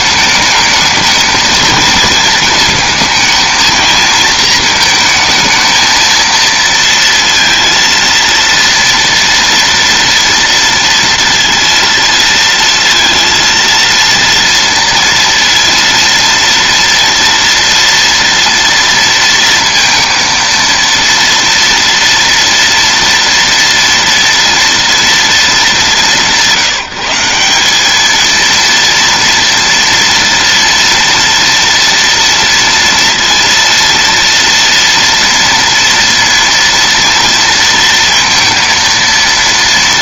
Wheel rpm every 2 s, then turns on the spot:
220, 220, 220, 230, 230, 230, 230, 230, 230, 230, 230, 240, 230, 180, 230, 230, 230, 230, 230, 230.
none